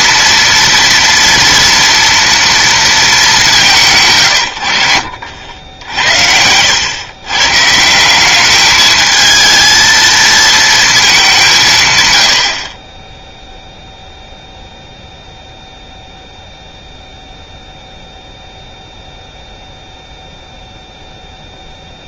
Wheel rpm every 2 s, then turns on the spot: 230, 230, 90, 100, 210, 220, 40, 0, 0, 0, 0.
none